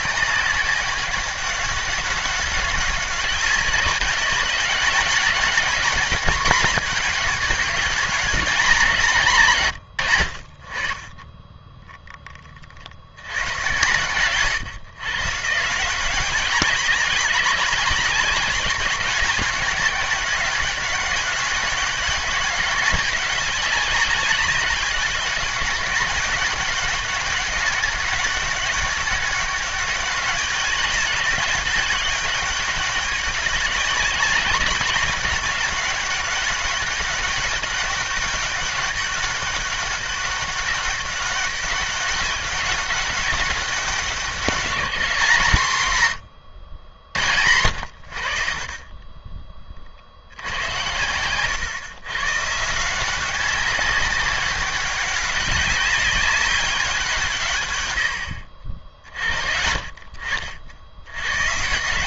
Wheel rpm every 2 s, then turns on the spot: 200, 190, 200, 220, 190, 60, 30, 130, 190, 200, 200, 200, 200, 200, 200, 200, 200, 190, 200, 200, 200, 200, 190, 90, 40, 100, 160, 190, 190, 60, 70.
none